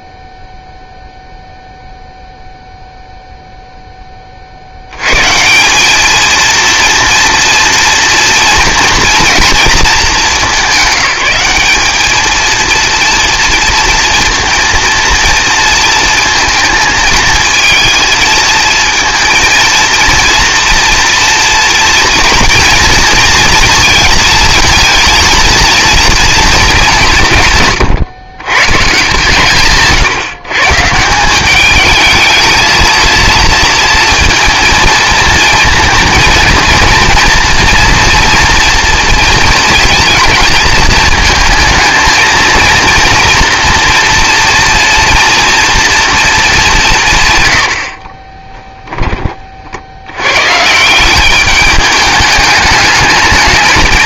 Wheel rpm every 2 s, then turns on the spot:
0, 0, 120, 230, 230, 200, 230, 230, 220, 220, 230, 240, 230, 180, 140, 170, 230, 230, 230, 230, 220, 230, 230, 150, 20, 170, 210.
none